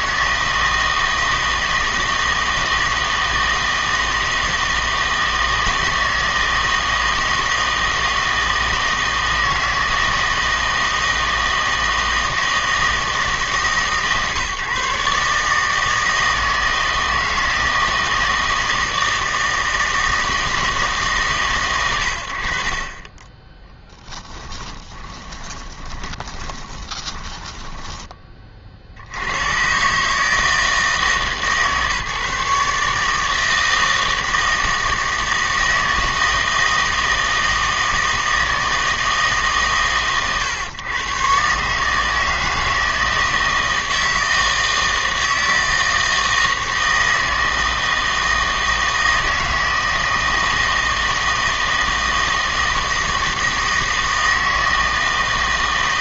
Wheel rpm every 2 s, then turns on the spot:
160, 160, 160, 160, 160, 160, 160, 140, 160, 160, 140, 30, 20, 20, 60, 150, 150, 160, 160, 160, 120, 160, 160, 160, 160, 160, 160, 160.
24-28